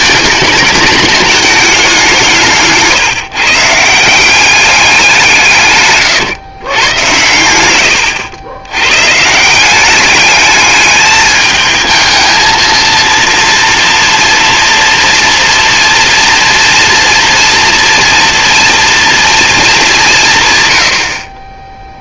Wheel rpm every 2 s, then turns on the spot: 210, 150, 200, 100, 110, 210, 220, 230, 240, 230, 90.
none